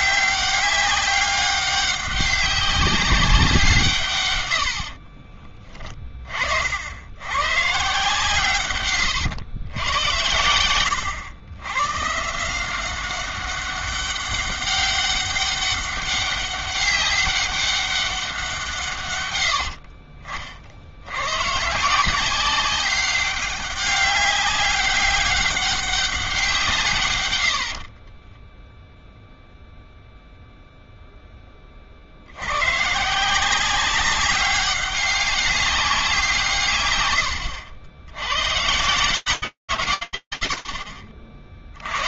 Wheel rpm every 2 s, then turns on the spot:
190, 180, 30, 110, 110, 100, 190, 200, 200, 110, 100, 200, 200, 120, 0, 0, 140, 200, 110, 130, 80.
4-6